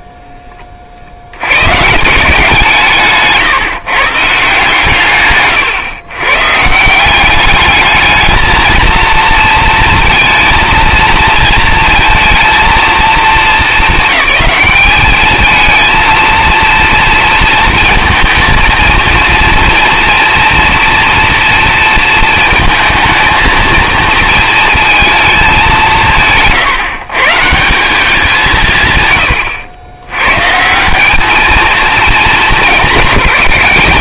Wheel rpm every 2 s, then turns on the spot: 20, 170, 150, 160, 230, 230, 220, 200, 230, 230, 230, 220, 230, 140, 150, 150, 200.
none